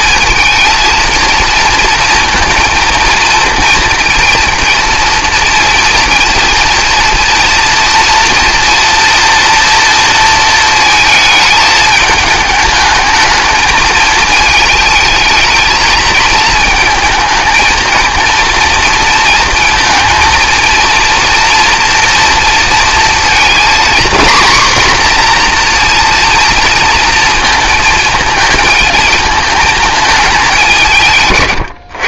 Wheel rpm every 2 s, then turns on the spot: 220, 230, 230, 230, 230, 230, 220, 220, 220, 230, 230, 230, 250, 230, 220, 200.
none